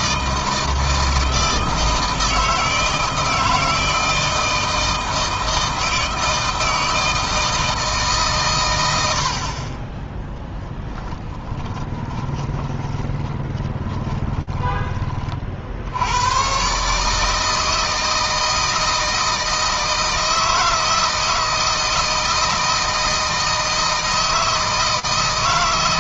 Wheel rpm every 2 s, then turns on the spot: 160, 160, 160, 160, 90, 10, 20, 20, 140, 160, 160, 160, 160.
10-14